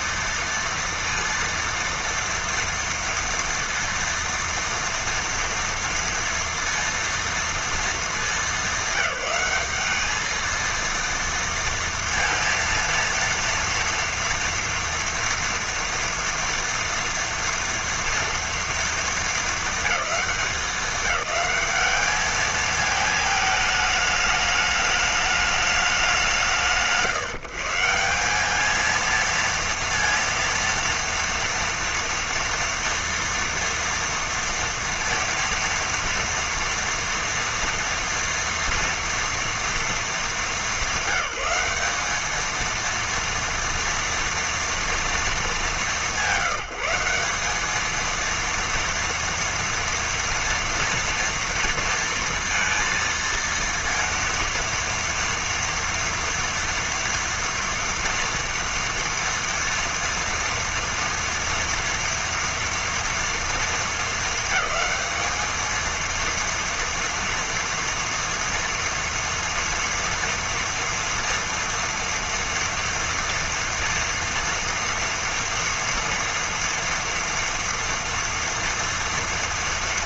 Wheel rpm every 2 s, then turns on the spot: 230, 230, 230, 230, 200, 220, 230, 230, 230, 230, 200, 220, 210, 160, 200, 230, 230, 230, 230, 230, 210, 220, 230, 180, 230, 230, 230, 230, 230, 230, 230, 230, 220, 230, 230, 230, 230, 230, 230, 230.
none